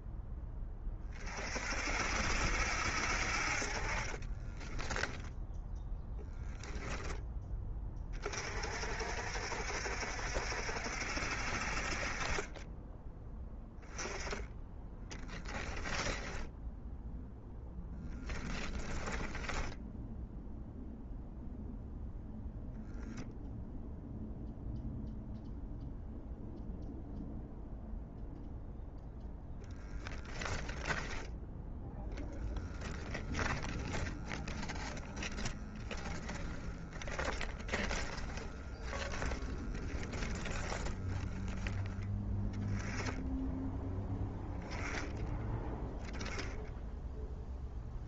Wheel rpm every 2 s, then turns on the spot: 20, 60, 20, 0, 50, 60, 20, 10, 0, 10, 0, 10, 0, 0, 0, 10, 10, 10, 10, 10, 10, 10, 0, 10.
4-6 18-20 30-34 36-42